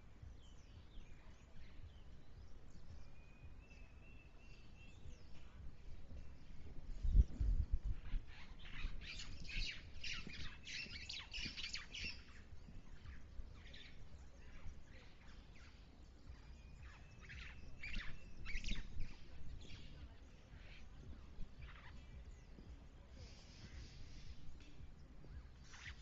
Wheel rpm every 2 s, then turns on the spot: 0, 0, 0, 0, 0, 0, 0, 0, 0, 0, 0, 0, 0.
none